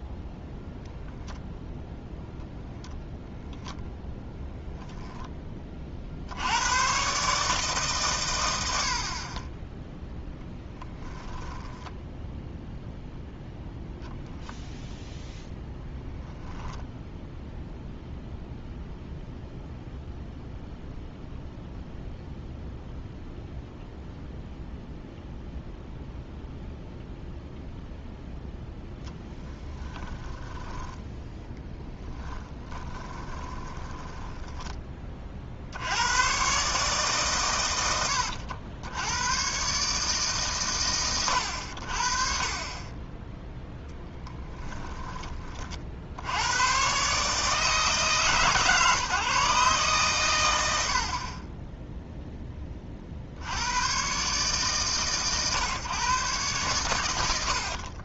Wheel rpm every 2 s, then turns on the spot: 0, 0, 0, 90, 80, 0, 0, 0, 0, 0, 0, 0, 0, 0, 0, 10, 20, 10, 130, 80, 120, 30, 10, 110, 150, 90, 20, 140, 120.
30-34 44-46 50-52